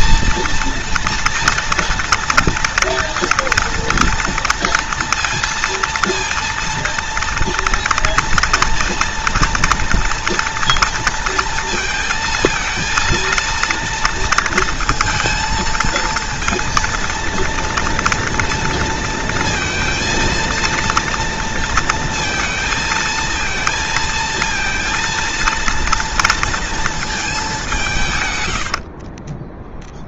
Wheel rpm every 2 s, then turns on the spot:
230, 230, 230, 230, 230, 230, 230, 230, 230, 230, 230, 220, 230, 220, 60.
28-30